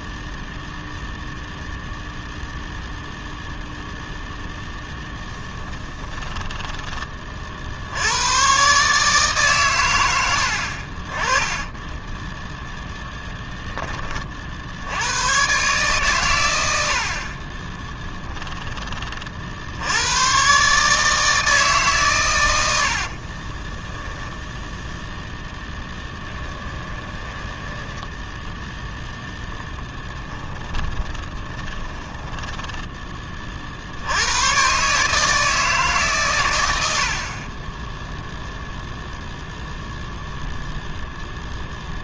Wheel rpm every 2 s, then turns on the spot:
0, 0, 0, 10, 130, 60, 10, 70, 70, 20, 140, 90, 0, 20, 0, 20, 10, 120, 80, 0, 0.
12-14 22-24 26-28 30-34